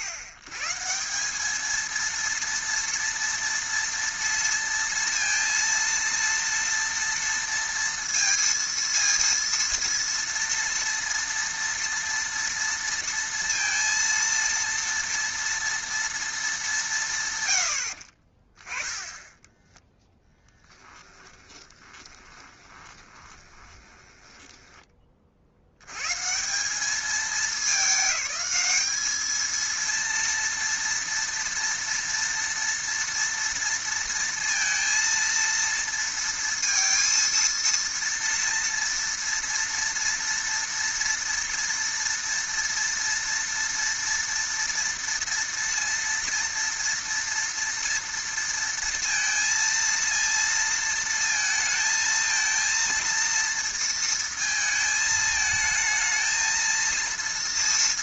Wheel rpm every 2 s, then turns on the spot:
120, 230, 230, 230, 230, 230, 230, 230, 200, 20, 10, 20, 20, 190, 210, 230, 230, 230, 230, 230, 230, 230, 230, 230, 230, 230, 230, 220, 230.
20-24